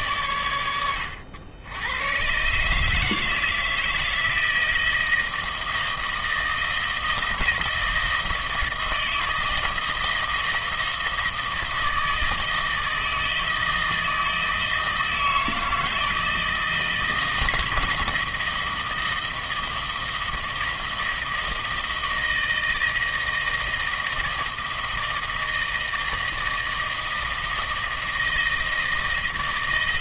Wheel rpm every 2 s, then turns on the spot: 90, 150, 160, 160, 160, 160, 160, 160, 160, 160, 160, 160, 160, 160, 160.
none